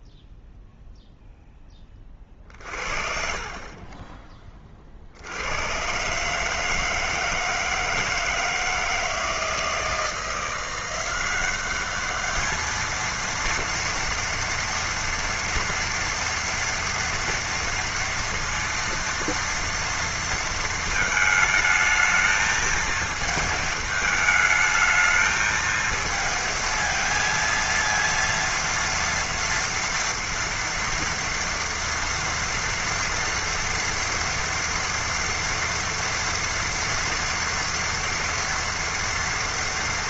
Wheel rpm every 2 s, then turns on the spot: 0, 50, 20, 150, 160, 170, 220, 230, 240, 230, 230, 220, 220, 230, 230, 230, 230, 230, 230, 230.
none